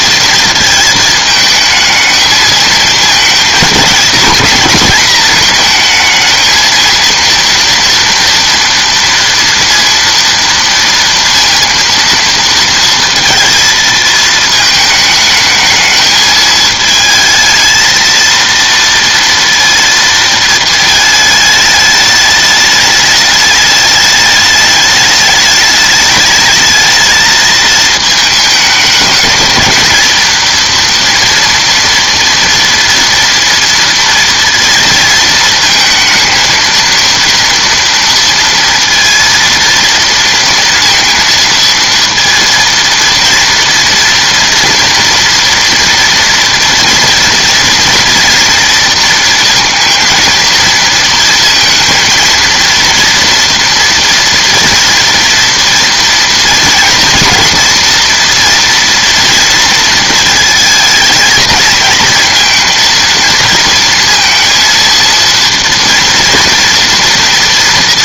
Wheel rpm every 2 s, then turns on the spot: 220, 220, 220, 220, 230, 230, 230, 220, 220, 230, 220, 210, 210, 220, 210, 230, 230, 230, 230, 230, 230, 230, 240, 230, 230, 230, 230, 230, 230, 230, 220, 230, 230, 230.
none